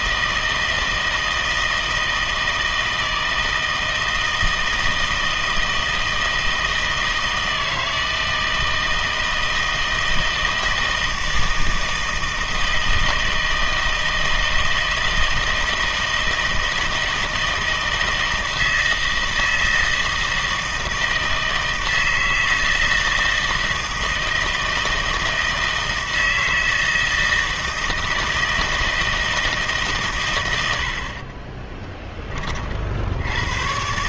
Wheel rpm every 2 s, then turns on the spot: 160, 160, 160, 160, 160, 160, 160, 160, 160, 160, 160, 160, 160, 160, 160, 80, 40.
none